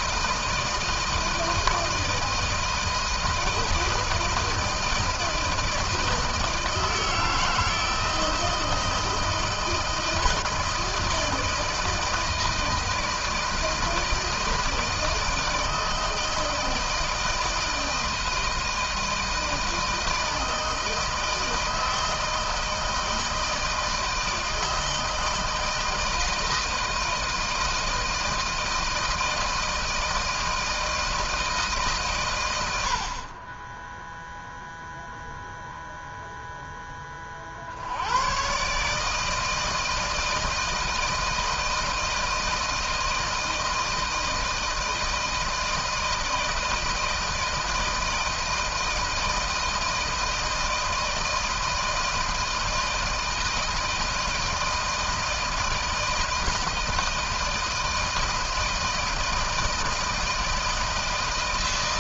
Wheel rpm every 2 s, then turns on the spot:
160, 160, 160, 160, 170, 160, 160, 160, 160, 160, 160, 160, 160, 160, 160, 160, 110, 0, 0, 120, 160, 160, 160, 160, 160, 160, 160, 160, 160, 160, 160.
none